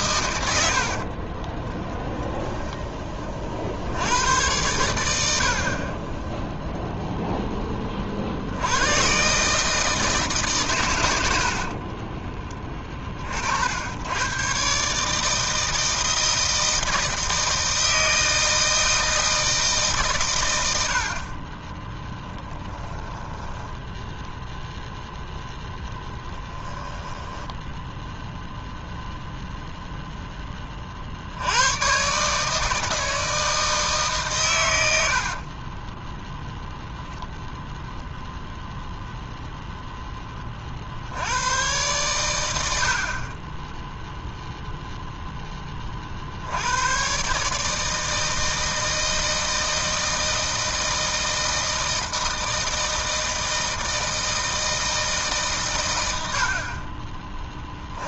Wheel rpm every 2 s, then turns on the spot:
60, 10, 100, 0, 120, 110, 30, 140, 160, 160, 60, 10, 0, 10, 0, 50, 160, 80, 0, 0, 60, 50, 0, 120, 160, 160, 160, 160, 30.
0-2 20-24 26-28